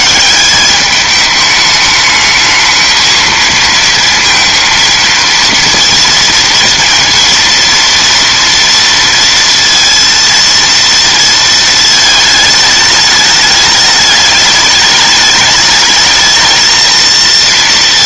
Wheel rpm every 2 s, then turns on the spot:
190, 220, 230, 230, 230, 230, 220, 210, 220.
none